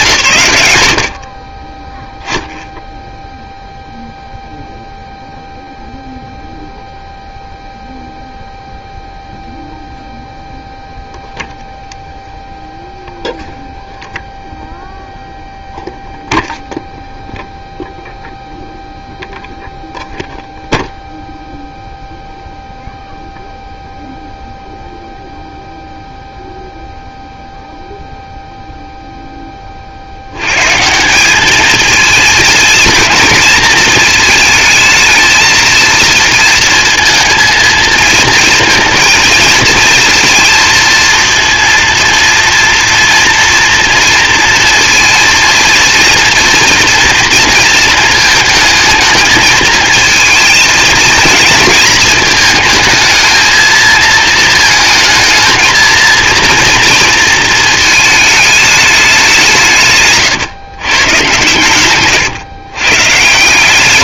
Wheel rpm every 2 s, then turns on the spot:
100, 0, 0, 0, 0, 0, 0, 0, 0, 0, 0, 0, 0, 0, 0, 180, 220, 220, 230, 230, 230, 230, 230, 230, 220, 230, 230, 220, 230, 200, 130, 130.
none